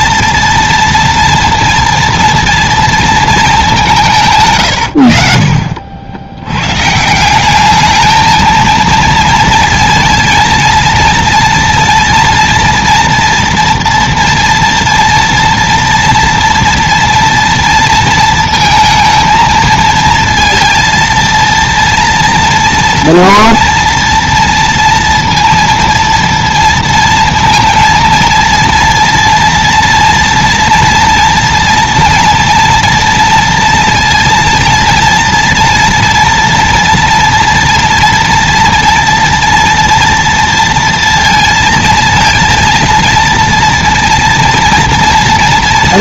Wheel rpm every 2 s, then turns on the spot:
230, 230, 110, 130, 230, 230, 230, 230, 230, 220, 230, 230, 230, 230, 230, 240, 230, 230, 230, 230, 230, 230, 230.
4-6